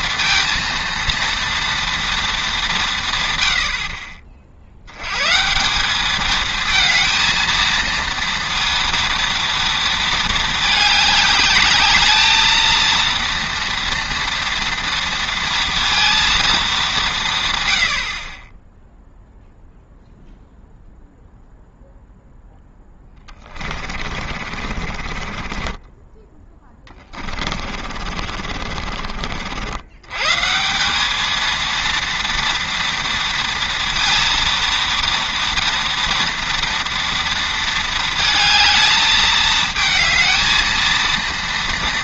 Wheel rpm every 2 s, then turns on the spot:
230, 190, 70, 220, 230, 220, 220, 230, 200, 10, 0, 10, 40, 20, 50, 190, 230, 230, 230, 220, 230.
24-30